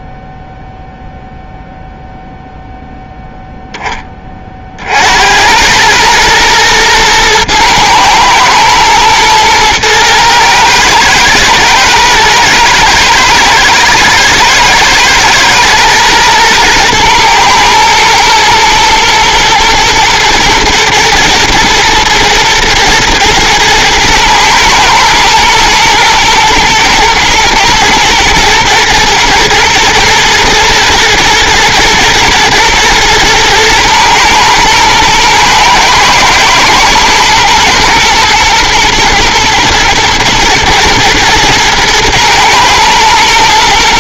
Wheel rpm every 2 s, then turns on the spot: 0, 0, 50, 110, 110, 110, 110, 110, 120, 110, 110, 120, 110, 110, 110, 120, 110, 110, 110, 110, 120, 110.
none